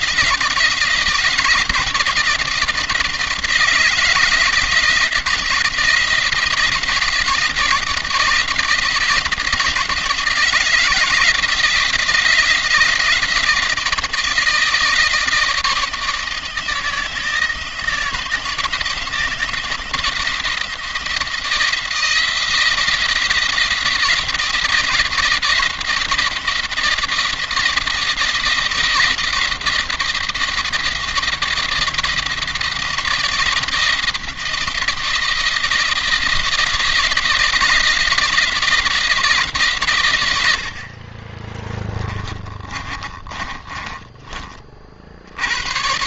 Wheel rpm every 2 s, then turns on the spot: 170, 170, 170, 160, 160, 170, 170, 160, 160, 160, 170, 170, 170, 170, 170, 170, 160, 170, 170, 170, 50, 30, 50.
40-44